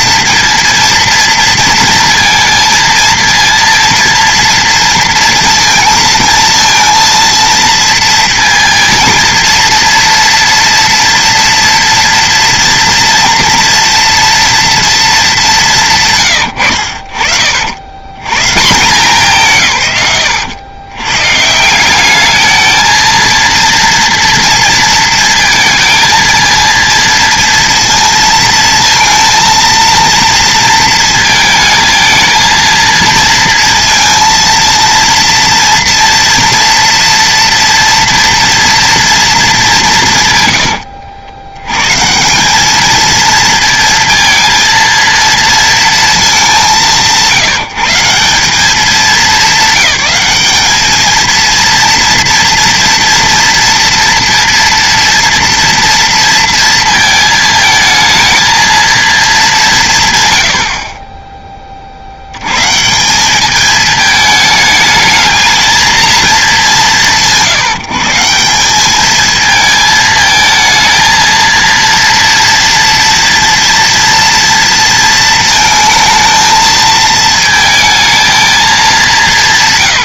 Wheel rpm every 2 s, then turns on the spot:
230, 230, 230, 230, 230, 230, 230, 230, 80, 160, 130, 220, 230, 230, 230, 220, 230, 230, 240, 230, 70, 210, 230, 200, 190, 210, 240, 230, 230, 230, 60, 160, 220, 200, 210, 230, 230, 230, 220, 190.
40-42 60-62